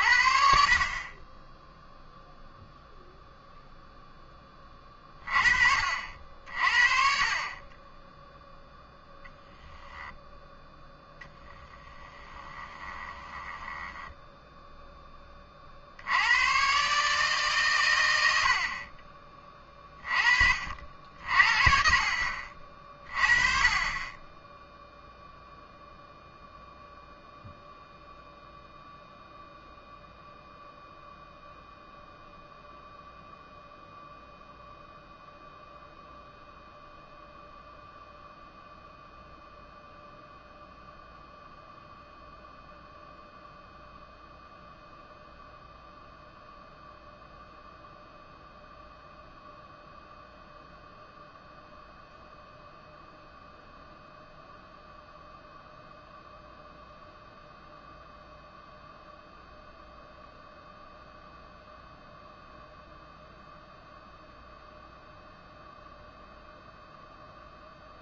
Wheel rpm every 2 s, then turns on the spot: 50, 0, 20, 60, 0, 10, 20, 10, 130, 50, 60, 50, 0, 0, 0, 0, 0, 0, 0, 0, 0, 0, 0, 0, 0, 0, 0, 0, 0, 0, 0, 0, 0, 0.
12-14